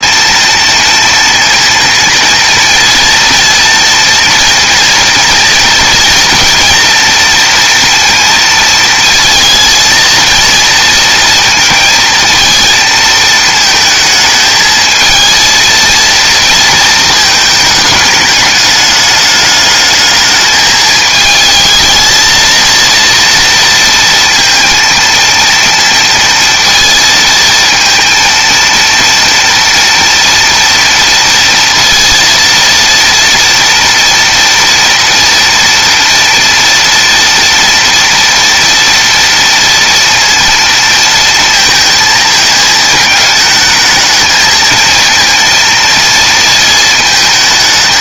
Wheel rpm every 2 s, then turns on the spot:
230, 230, 230, 230, 230, 230, 220, 220, 230, 210, 220, 220, 230, 230, 230, 230, 230, 230, 230, 230, 230, 220, 220, 230.
none